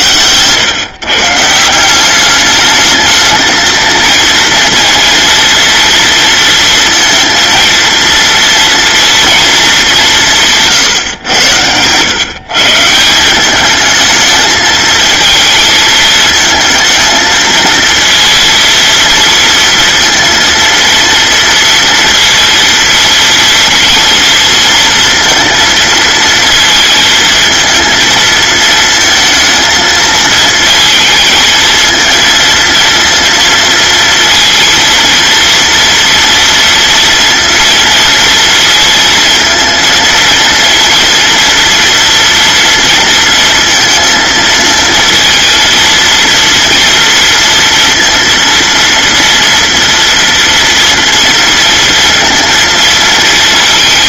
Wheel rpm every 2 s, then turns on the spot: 130, 210, 230, 230, 230, 140, 150, 220, 230, 230, 230, 230, 230, 230, 230, 230, 230, 230, 230, 230, 230, 230, 220, 230, 230, 230, 230.
none